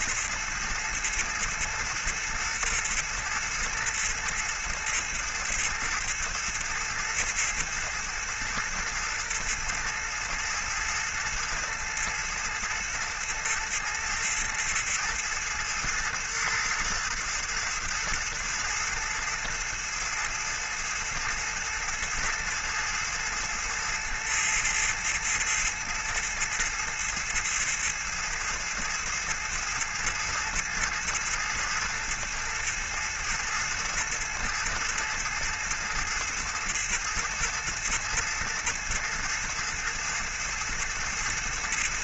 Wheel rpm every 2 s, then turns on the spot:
110, 110, 110, 110, 110, 110, 110, 110, 110, 110, 110, 110, 110, 110, 110, 110, 110, 110, 110, 110, 120.
none